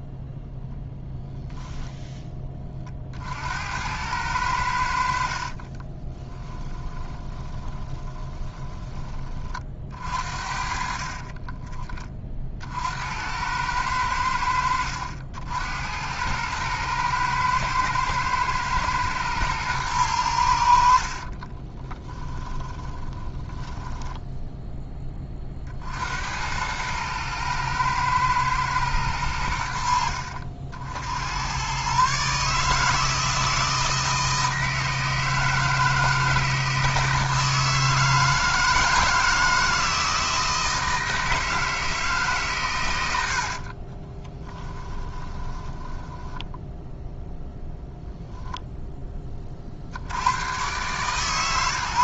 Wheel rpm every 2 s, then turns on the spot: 0, 20, 90, 20, 20, 50, 50, 90, 110, 110, 90, 20, 10, 90, 110, 70, 150, 160, 160, 160, 160, 140, 10, 0, 0, 120.
6-12 22-24 44-46